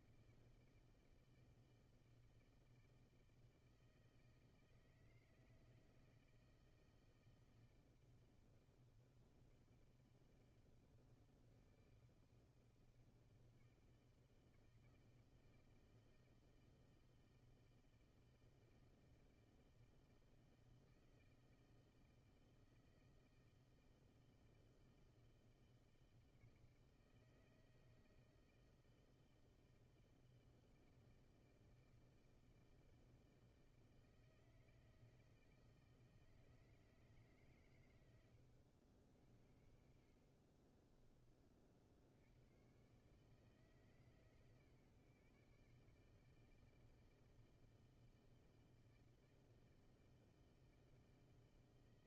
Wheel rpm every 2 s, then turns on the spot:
160, 160, 160, 160, 160, 160, 160, 160, 160, 160, 160, 160, 160, 160, 160, 160, 160, 160, 160, 90, 40, 110, 140, 160, 160, 160.
40-42